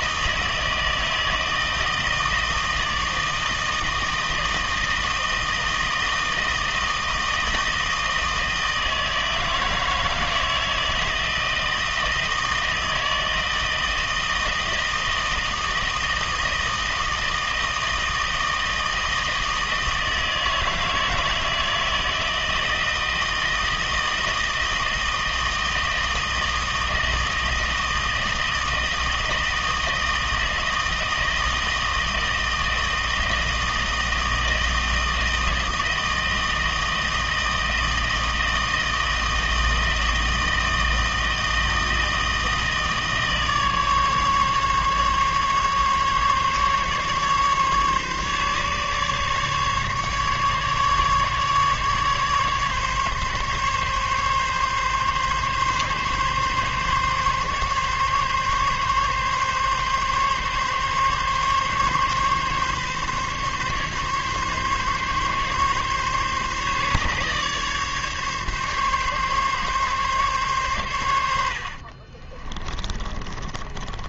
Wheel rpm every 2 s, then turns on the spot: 160, 160, 160, 160, 160, 160, 160, 160, 160, 160, 160, 160, 160, 160, 160, 160, 160, 160, 160, 160, 160, 160, 140, 150, 140, 150, 140, 140, 140, 140, 140, 140, 140, 140, 140, 120, 30.
72-74